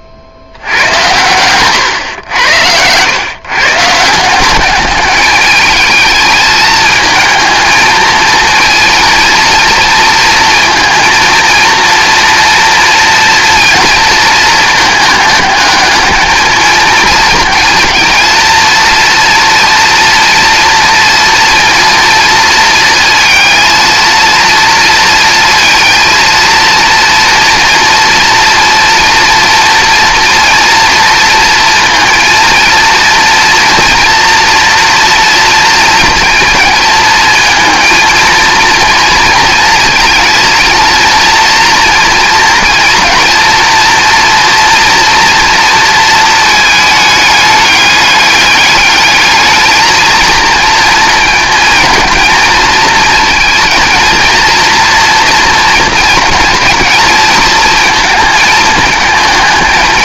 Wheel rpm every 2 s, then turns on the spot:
70, 100, 190, 220, 230, 230, 230, 220, 220, 230, 230, 230, 230, 230, 230, 230, 230, 240, 230, 230, 220, 230, 230, 220, 210, 230, 220, 230, 230, 220.
none